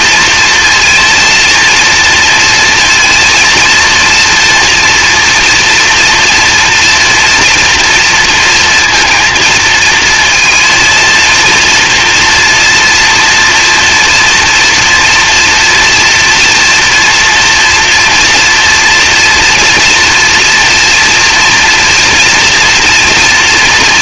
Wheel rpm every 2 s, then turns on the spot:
240, 230, 240, 230, 230, 230, 230, 230, 230, 230, 230, 230.
none